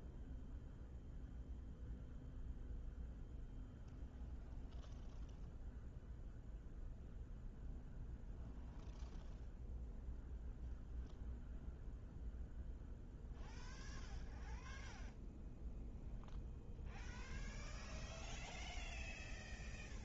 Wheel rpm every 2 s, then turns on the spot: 0, 0, 0, 0, 0, 0, 0, 0, 0, 0.
none